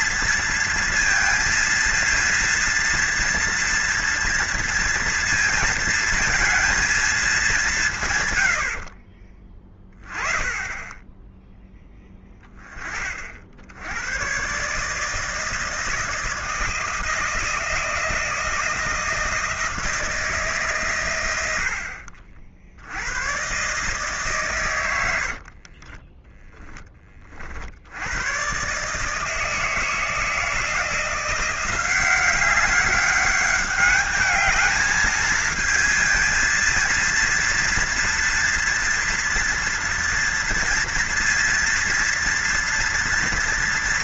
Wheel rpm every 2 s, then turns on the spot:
230, 230, 230, 230, 70, 10, 20, 140, 160, 170, 140, 70, 110, 10, 140, 170, 190, 210, 230, 230, 230, 230.
none